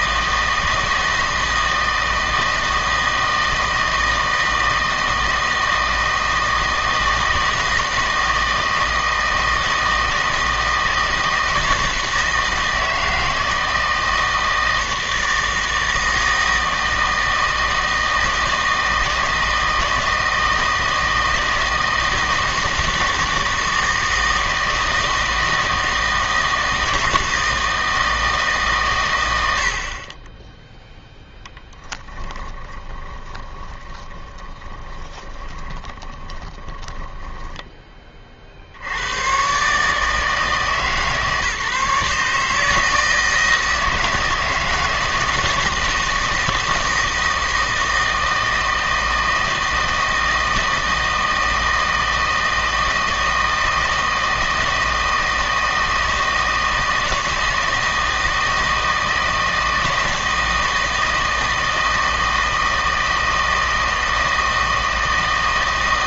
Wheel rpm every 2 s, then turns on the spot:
160, 160, 160, 160, 160, 160, 160, 160, 160, 160, 160, 160, 160, 160, 130, 0, 20, 20, 20, 70, 150, 160, 160, 160, 160, 160, 160, 160, 160, 160, 160, 160, 160.
32-38